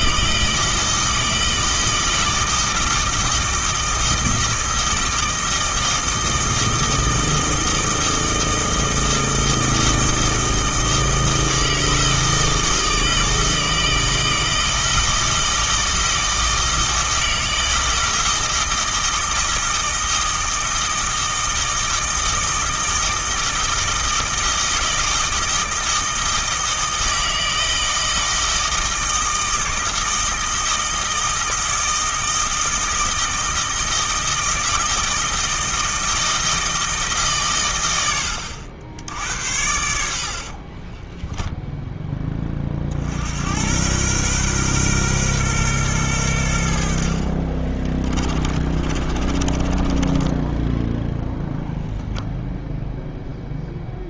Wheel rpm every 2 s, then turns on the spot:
160, 160, 160, 160, 160, 160, 160, 160, 160, 160, 160, 160, 160, 160, 160, 160, 160, 160, 160, 80, 30, 50, 120, 70, 30, 10, 0.
40-42 48-50